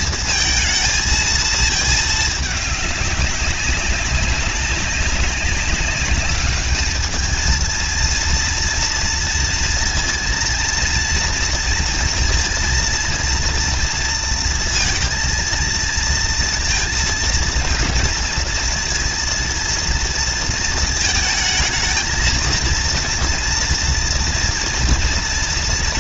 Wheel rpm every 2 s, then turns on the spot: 230, 210, 190, 200, 230, 230, 230, 230, 230, 230, 230, 230, 240.
none